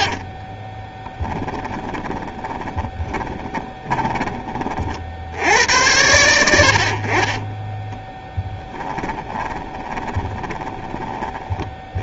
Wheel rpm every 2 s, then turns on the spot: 10, 20, 30, 60, 10, 20.
0-4 8-10